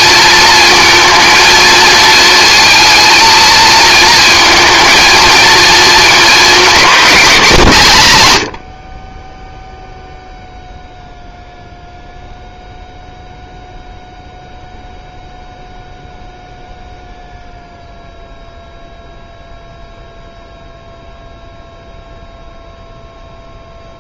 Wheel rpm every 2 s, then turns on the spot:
230, 230, 230, 210, 40, 0, 0, 0, 0, 0, 0, 0.
none